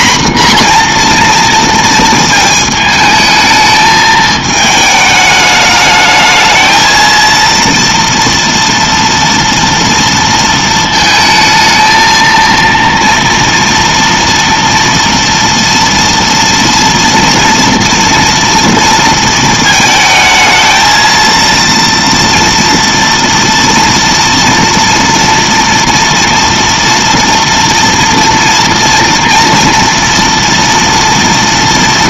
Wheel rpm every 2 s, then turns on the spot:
240, 220, 220, 220, 230, 220, 230, 230, 230, 230, 220, 230, 230, 230, 230, 230.
none